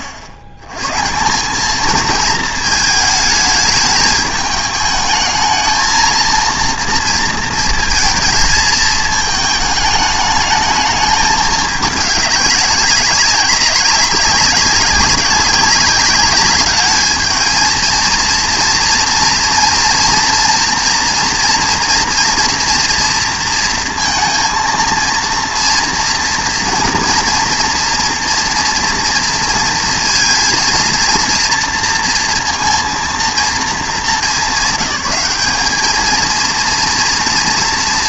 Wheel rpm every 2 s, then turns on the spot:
90, 220, 220, 230, 220, 210, 200, 190, 210, 230, 230, 240, 230, 240, 230, 230, 230, 210, 230.
none